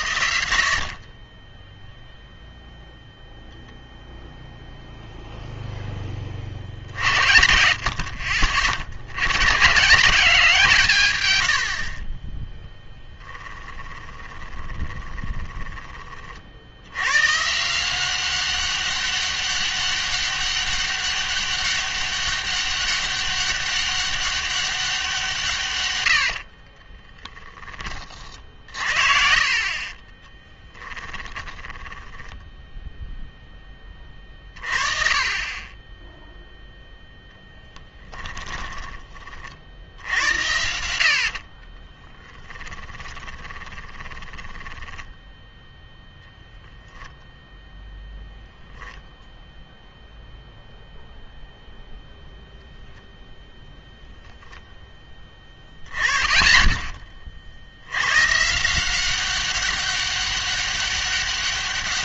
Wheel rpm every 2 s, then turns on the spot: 50, 0, 0, 60, 50, 160, 10, 20, 80, 190, 200, 200, 190, 30, 50, 10, 10, 30, 0, 20, 70, 20, 10, 0, 0, 0, 0, 10, 20, 160, 200.
14-16 26-28 30-32 38-40 42-46